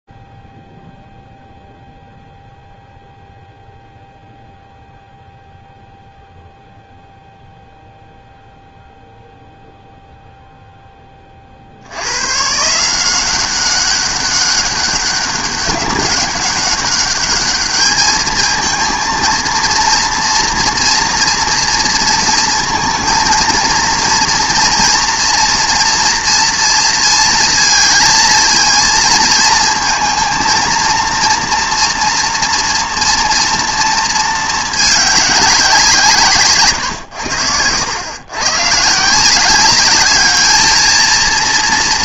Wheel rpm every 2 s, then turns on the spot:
0, 0, 0, 0, 0, 0, 160, 200, 200, 230, 230, 230, 230, 230, 230, 230, 230, 210, 120, 140, 220.
none